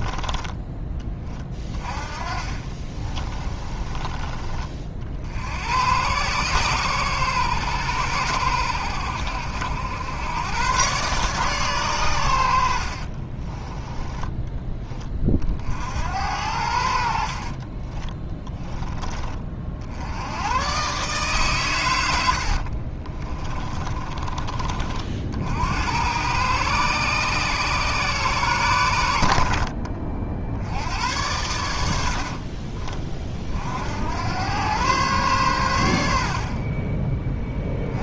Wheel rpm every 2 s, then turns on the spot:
20, 30, 50, 120, 80, 130, 50, 20, 70, 20, 130, 40, 50, 130, 90, 90, 30, 120, 20.
0-4 12-14 22-24